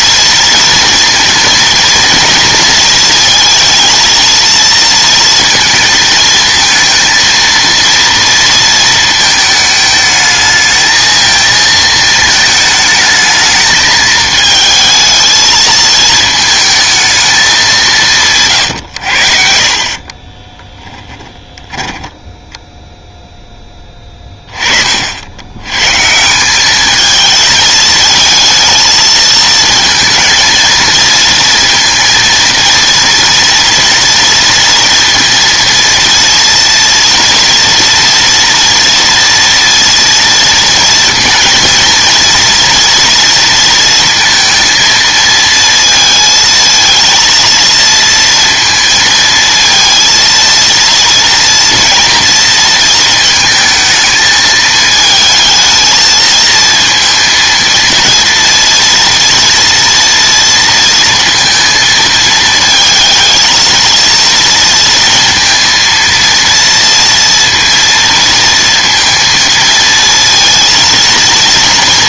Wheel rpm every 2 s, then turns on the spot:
230, 230, 230, 220, 230, 220, 220, 220, 220, 130, 20, 10, 40, 190, 220, 230, 230, 230, 230, 230, 230, 230, 230, 230, 230, 230, 230, 220, 230, 230, 230, 220, 230, 230, 230, 230.
18-22